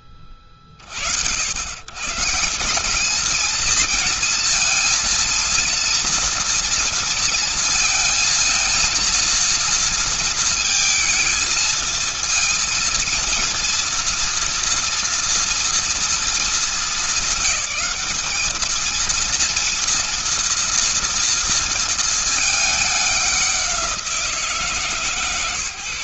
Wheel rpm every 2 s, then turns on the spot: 40, 190, 230, 230, 230, 220, 230, 240, 220, 220, 230, 210, 150.
none